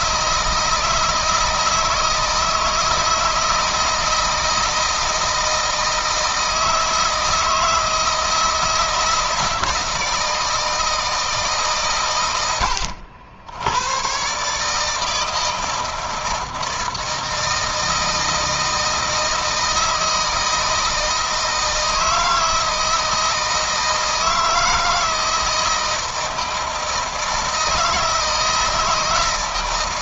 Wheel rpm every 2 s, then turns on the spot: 160, 160, 160, 160, 160, 160, 100, 150, 160, 160, 160, 160, 160, 160, 160.
none